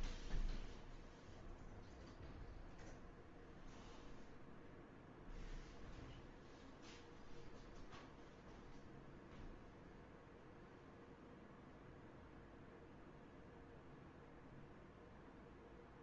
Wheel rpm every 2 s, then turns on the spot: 0, 0, 0, 0, 0, 0, 0, 0.
none